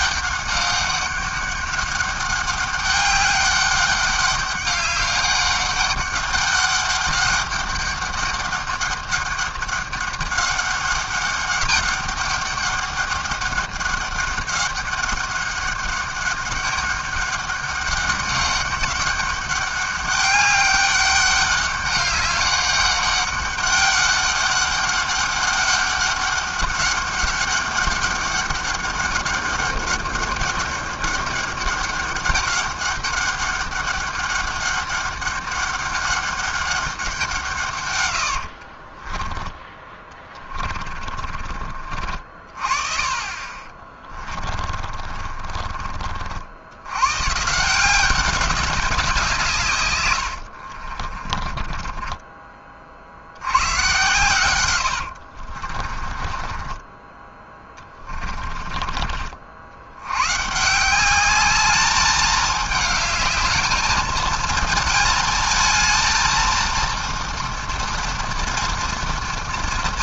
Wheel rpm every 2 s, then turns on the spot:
200, 200, 200, 200, 200, 200, 200, 200, 200, 200, 200, 200, 200, 200, 200, 200, 200, 200, 200, 50, 30, 50, 30, 90, 200, 50, 40, 100, 20, 30, 160, 210, 220, 230, 230.
38-42 44-46 50-52 54-58